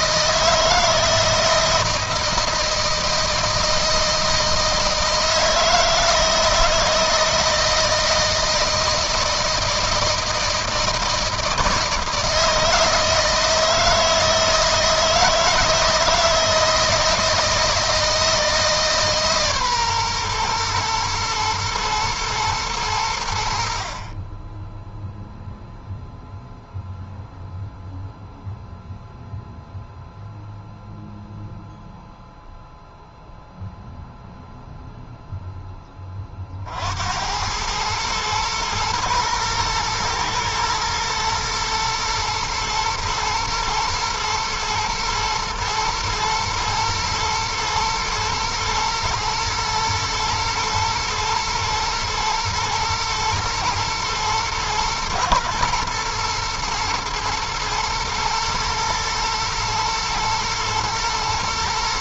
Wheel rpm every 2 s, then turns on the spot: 160, 160, 160, 160, 160, 160, 160, 160, 160, 150, 120, 90, 0, 0, 0, 0, 0, 0, 80, 120, 110, 120, 110, 110, 110, 110, 120, 110, 110, 120, 120.
none